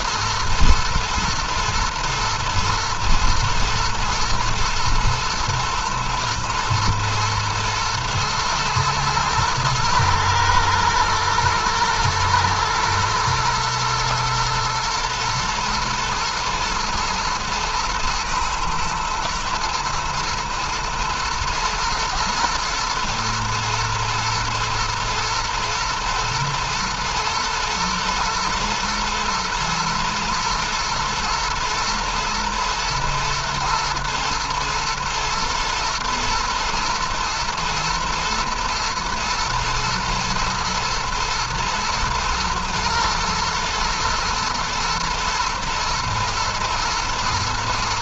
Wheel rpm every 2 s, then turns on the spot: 120, 110, 120, 120, 120, 120, 110, 110, 120, 110, 120, 120, 120, 120, 120, 110, 120, 120, 120, 120, 120, 110, 120, 120.
none